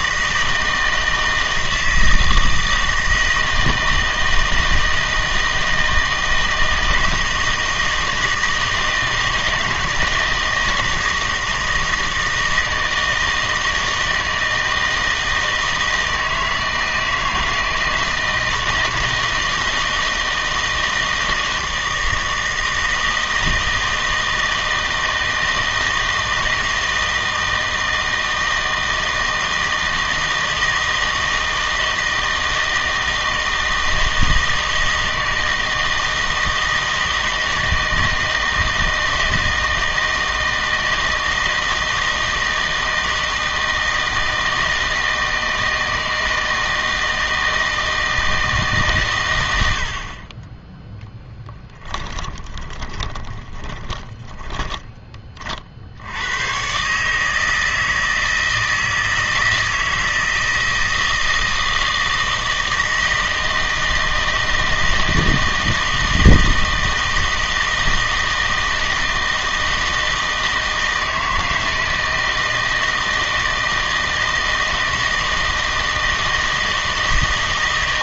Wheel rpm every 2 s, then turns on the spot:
160, 160, 160, 160, 160, 160, 160, 160, 160, 160, 160, 160, 160, 160, 160, 160, 160, 160, 160, 160, 160, 160, 160, 160, 150, 10, 20, 10, 120, 160, 160, 160, 160, 160, 160, 160, 160, 160, 160.
52-56